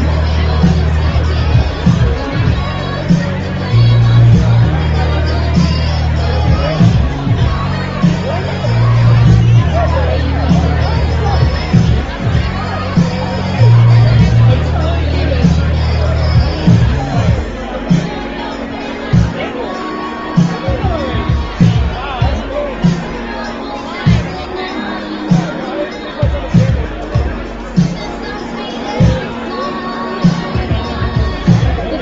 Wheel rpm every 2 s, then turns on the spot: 0, 0, 0, 0, 0, 0, 0, 0, 0, 0, 0, 0, 0, 0, 0, 0.
none